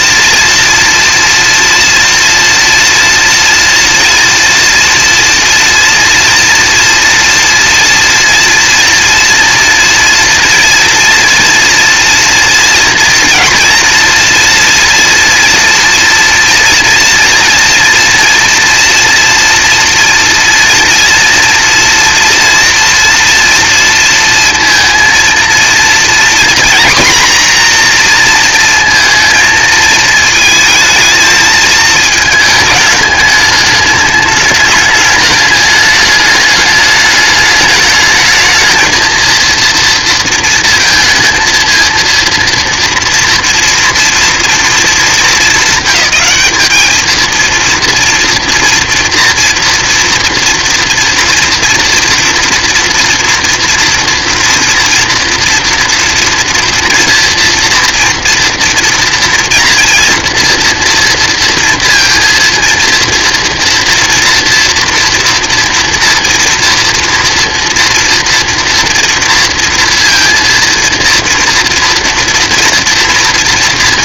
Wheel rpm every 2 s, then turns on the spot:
230, 230, 230, 230, 230, 230, 230, 230, 230, 230, 230, 240, 230, 240, 230, 220, 210, 210, 210, 220, 230, 230, 220, 210, 230, 230, 230, 230, 240, 230, 230, 230, 230, 230, 230, 230, 230.
none